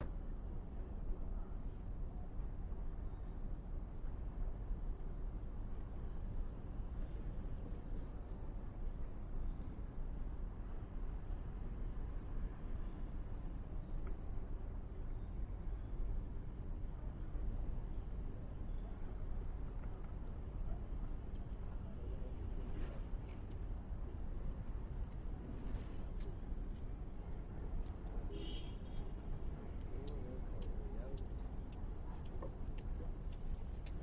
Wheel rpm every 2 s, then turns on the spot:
0, 0, 0, 0, 0, 0, 0, 0, 0, 0, 0, 0, 0, 0, 0, 0, 0.
none